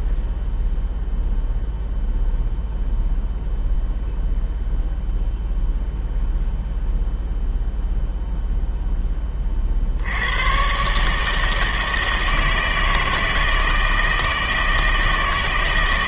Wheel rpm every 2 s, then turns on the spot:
0, 0, 0, 0, 0, 130, 160, 160.
none